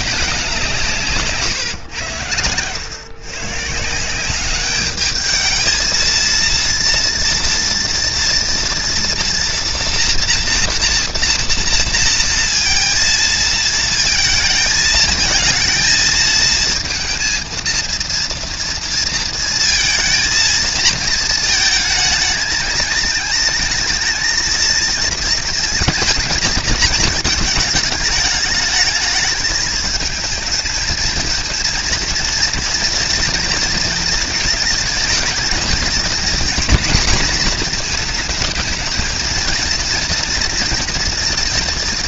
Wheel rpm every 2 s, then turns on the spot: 190, 100, 190, 230, 240, 230, 230, 220, 230, 230, 230, 220, 230, 220, 210, 220, 230, 220, 240, 220, 230.
none